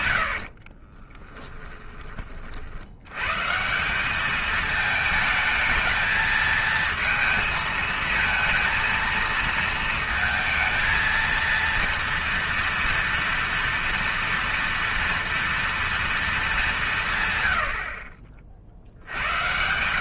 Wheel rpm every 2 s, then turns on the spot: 70, 60, 210, 220, 230, 230, 230, 230, 200, 50.
0-2